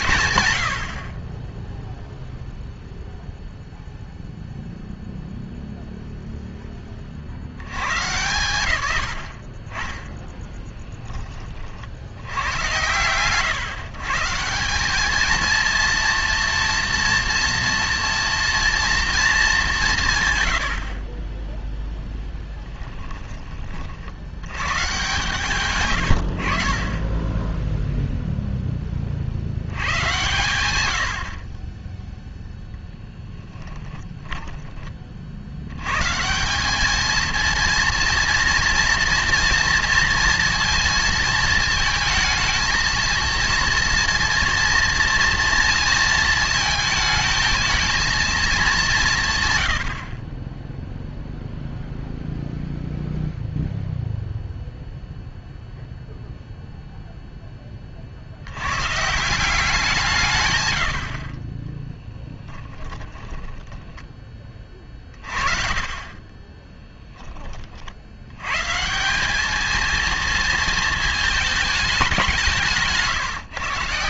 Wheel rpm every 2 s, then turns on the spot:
70, 0, 0, 10, 100, 10, 120, 190, 230, 240, 70, 10, 120, 40, 20, 110, 0, 20, 210, 230, 230, 220, 230, 220, 200, 0, 0, 0, 0, 130, 100, 30, 40, 20, 140, 220, 160.
62-64 66-68